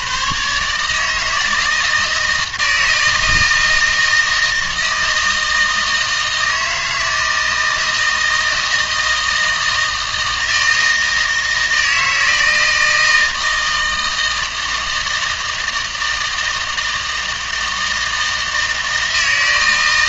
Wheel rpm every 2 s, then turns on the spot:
140, 160, 160, 160, 160, 160, 160, 160, 160, 160.
none